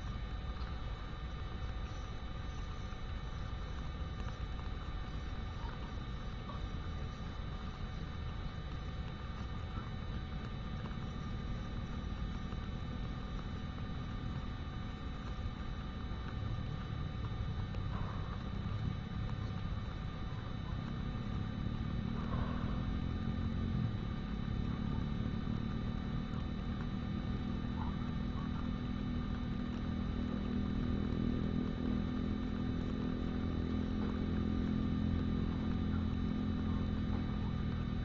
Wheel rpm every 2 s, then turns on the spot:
0, 0, 0, 0, 0, 0, 0, 0, 0, 0, 0, 0, 0, 0, 0, 0, 0, 0, 0.
none